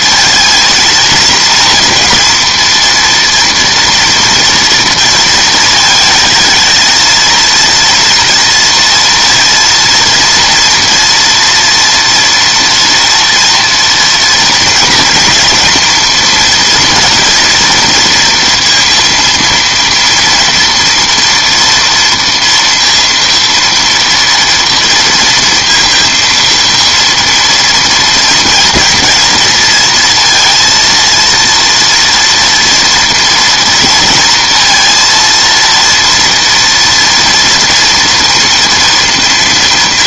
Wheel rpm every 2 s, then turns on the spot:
220, 230, 230, 220, 230, 230, 240, 230, 230, 230, 240, 230, 230, 230, 230, 230, 230, 230, 230, 230.
none